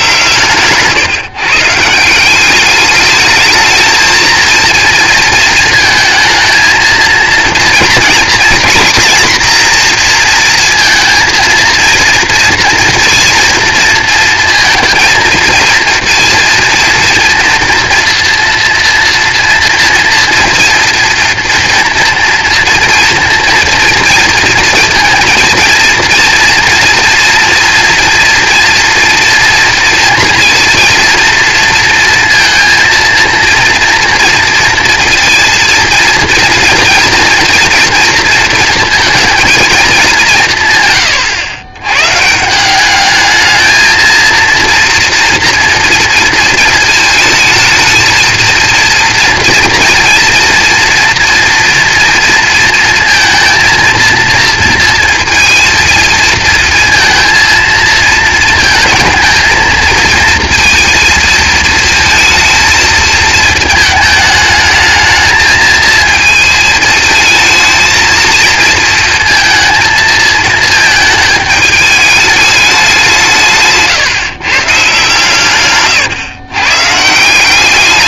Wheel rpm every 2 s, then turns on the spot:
140, 210, 230, 220, 240, 230, 230, 230, 230, 230, 230, 230, 230, 230, 230, 230, 230, 230, 230, 220, 130, 190, 230, 220, 230, 230, 230, 230, 230, 230, 230, 230, 220, 220, 230, 220, 200, 140, 140.
none